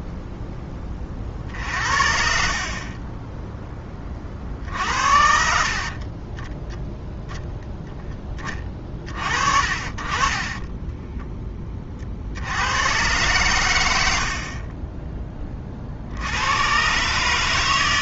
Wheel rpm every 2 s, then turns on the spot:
10, 40, 50, 10, 30, 20, 90, 20, 140.
4-6